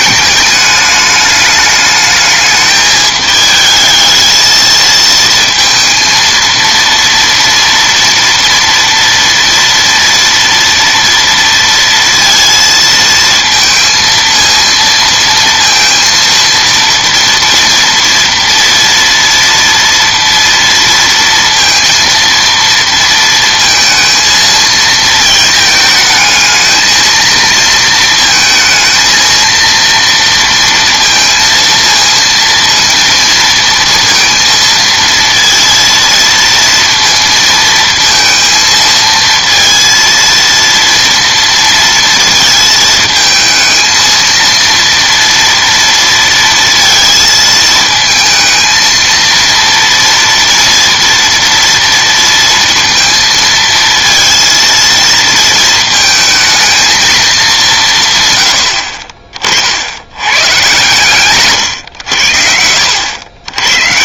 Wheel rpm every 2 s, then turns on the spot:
210, 210, 220, 230, 230, 230, 230, 230, 230, 230, 230, 230, 230, 220, 230, 230, 230, 230, 230, 230, 230, 220, 230, 230, 220, 230, 230, 230, 220, 70, 130, 70.
none